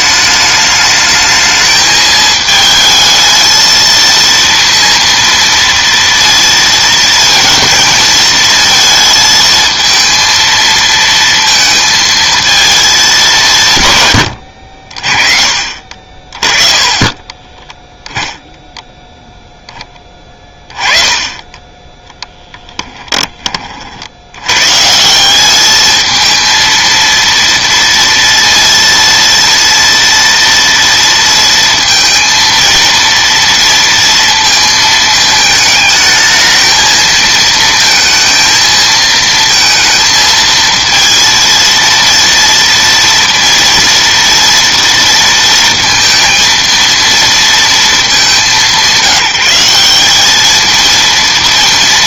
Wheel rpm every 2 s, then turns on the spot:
210, 220, 230, 230, 230, 230, 220, 60, 30, 10, 20, 10, 140, 230, 230, 230, 230, 230, 220, 220, 230, 230, 230, 230, 180, 220.
16-18